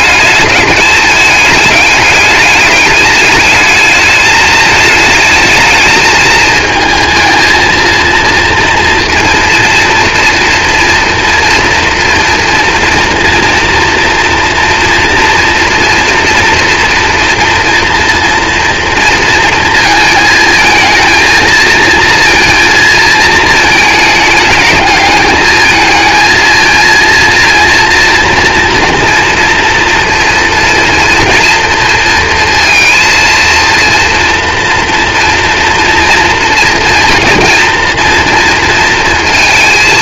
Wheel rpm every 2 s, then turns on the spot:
210, 210, 220, 220, 230, 230, 230, 230, 230, 230, 220, 230, 220, 230, 230, 230, 230, 240, 230, 230.
none